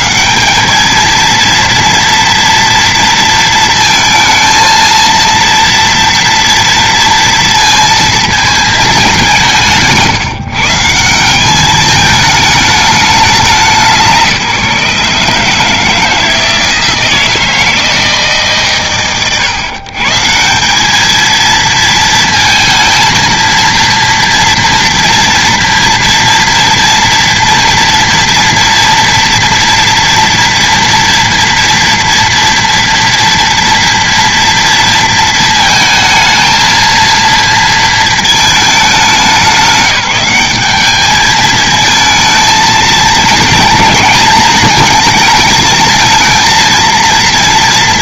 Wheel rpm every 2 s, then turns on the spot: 140, 230, 230, 230, 230, 130, 210, 160, 160, 160, 130, 220, 230, 230, 240, 230, 230, 230, 220, 230, 190, 220, 230, 230.
none